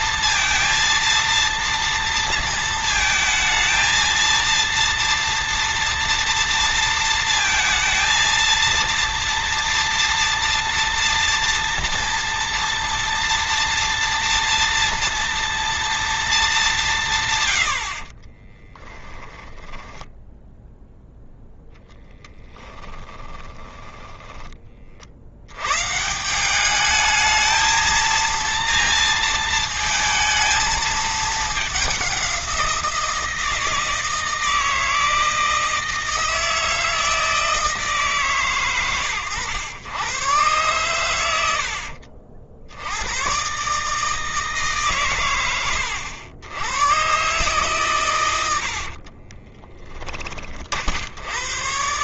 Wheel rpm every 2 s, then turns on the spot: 230, 230, 230, 230, 230, 230, 240, 230, 190, 10, 0, 10, 40, 210, 230, 220, 170, 160, 160, 120, 120, 90, 130, 120, 60, 60.
18-20 22-24 48-50